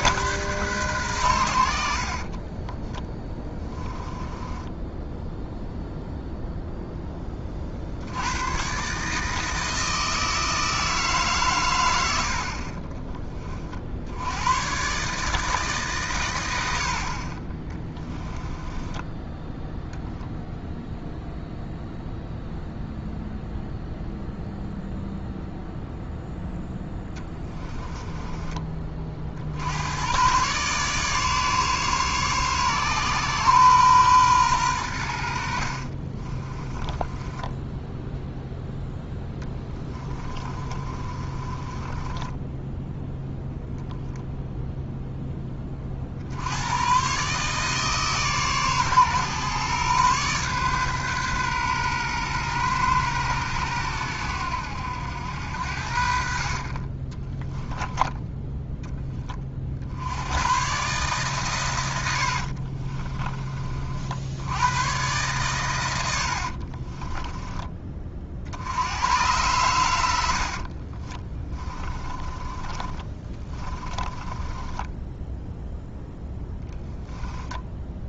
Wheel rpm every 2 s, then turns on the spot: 120, 20, 10, 10, 150, 160, 30, 130, 60, 10, 0, 0, 0, 10, 30, 140, 130, 100, 20, 0, 30, 0, 0, 110, 130, 130, 110, 90, 30, 10, 130, 40, 110, 30, 90, 40, 20, 10, 10.
2-6 12-14 18-20 26-28 36-38 40-42 56-58 62-64 66-68 70-78